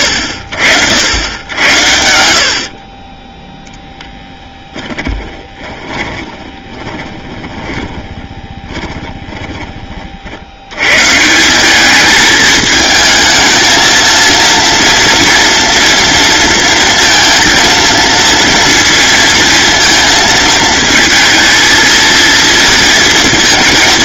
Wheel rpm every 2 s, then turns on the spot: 70, 50, 20, 30, 10, 100, 220, 230, 230, 230, 220, 230.
4-10